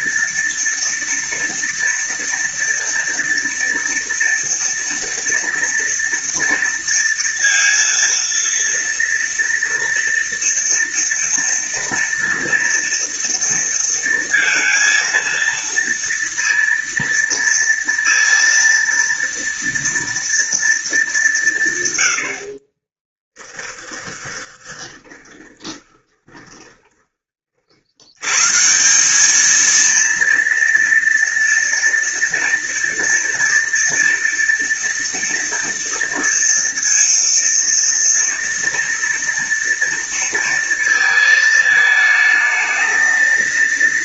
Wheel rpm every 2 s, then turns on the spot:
240, 230, 230, 230, 230, 230, 230, 230, 230, 230, 220, 40, 30, 20, 170, 230, 230, 230, 230, 230, 220, 220.
22-28